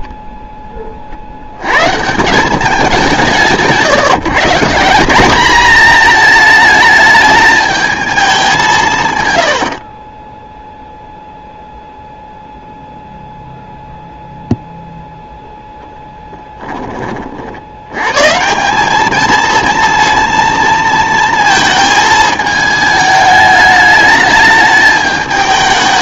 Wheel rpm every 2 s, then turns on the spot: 30, 200, 170, 220, 140, 0, 0, 0, 20, 190, 230, 220, 210.
none